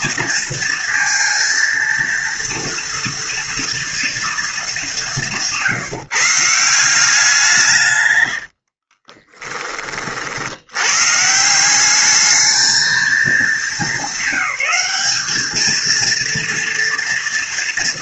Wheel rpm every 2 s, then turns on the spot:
230, 230, 220, 160, 70, 80, 220, 200, 230.
8-10